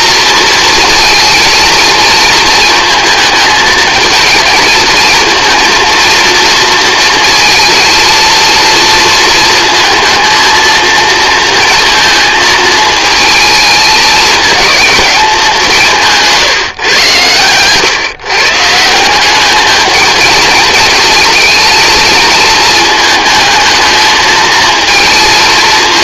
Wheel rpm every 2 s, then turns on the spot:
230, 220, 230, 230, 220, 230, 220, 160, 140, 220, 230, 220, 210.
none